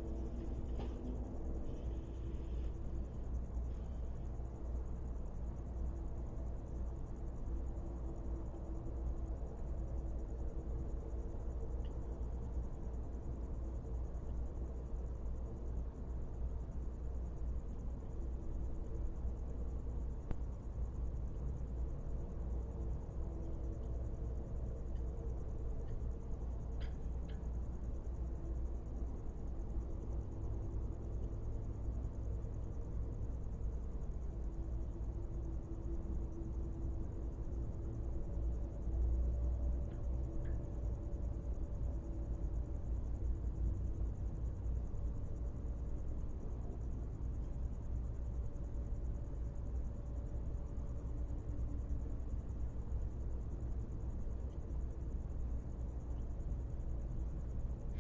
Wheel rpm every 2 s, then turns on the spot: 0, 0, 0, 0, 0, 0, 0, 0, 0, 0, 0, 0, 0, 0, 0, 0, 0, 0, 0, 0, 0, 0, 0, 0, 0, 0, 0, 0, 0.
none